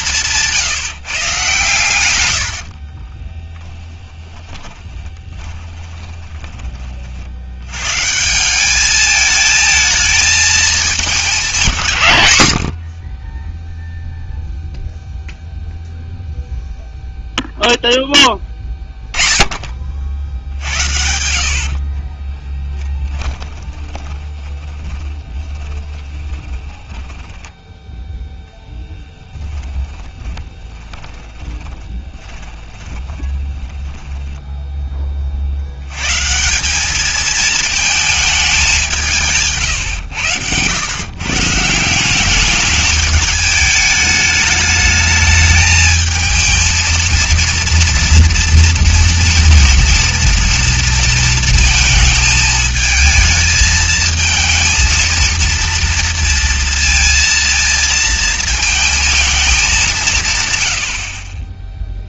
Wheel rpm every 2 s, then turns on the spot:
170, 90, 30, 30, 180, 220, 80, 0, 0, 10, 70, 10, 20, 10, 10, 20, 10, 10, 170, 210, 100, 210, 210, 220, 230, 230, 220, 220, 230, 220, 120.
0-6 22-28 30-36